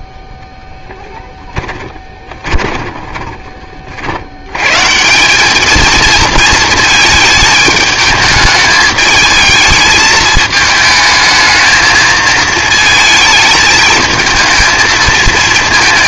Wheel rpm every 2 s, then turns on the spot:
10, 20, 150, 220, 210, 220, 220, 220.
2-4